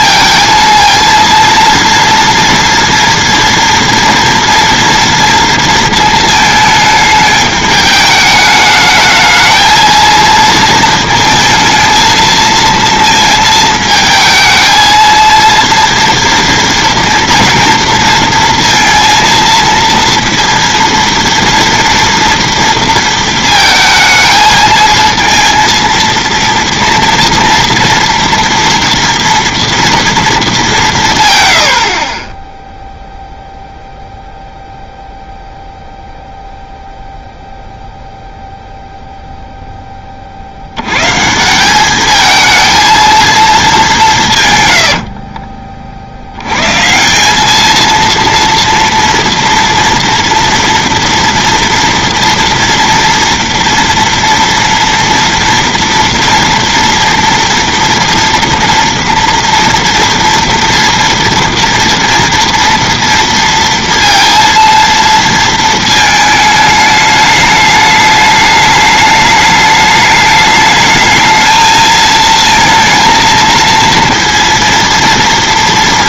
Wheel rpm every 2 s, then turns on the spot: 230, 230, 230, 220, 210, 230, 230, 220, 230, 230, 230, 230, 220, 230, 230, 200, 10, 0, 0, 0, 70, 220, 100, 110, 230, 230, 230, 230, 230, 230, 230, 230, 230, 210, 210, 210, 230, 230.
44-46